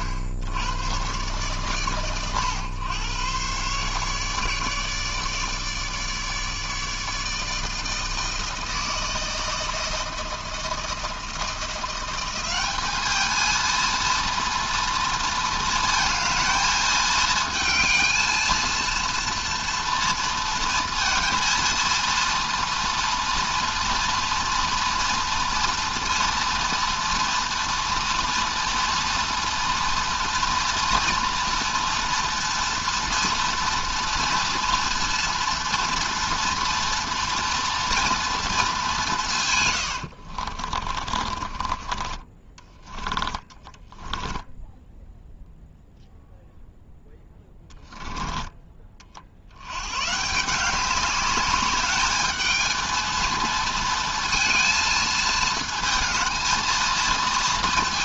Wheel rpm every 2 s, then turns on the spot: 90, 120, 150, 150, 160, 160, 200, 230, 220, 230, 230, 240, 230, 240, 230, 230, 230, 230, 240, 220, 50, 30, 10, 0, 20, 170, 220, 230, 220.
40-46 48-50